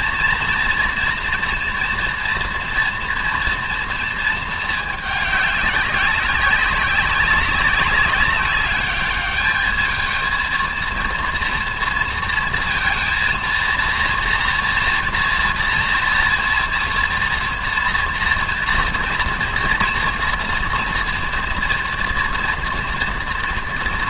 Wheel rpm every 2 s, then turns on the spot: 230, 230, 220, 200, 200, 230, 230, 240, 240, 230, 230, 230.
none